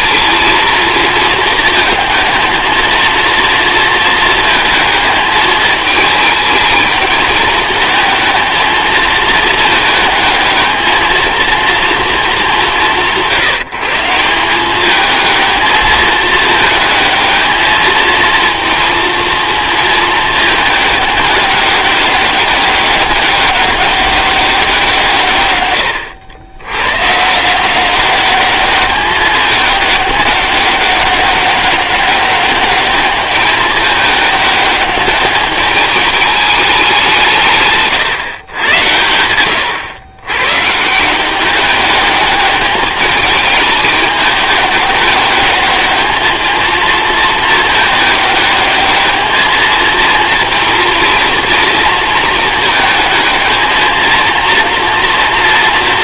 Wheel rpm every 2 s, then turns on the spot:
230, 230, 220, 220, 220, 220, 190, 200, 220, 230, 210, 200, 170, 110, 200, 200, 200, 210, 200, 110, 140, 210, 210, 230, 210, 230, 220, 230.
none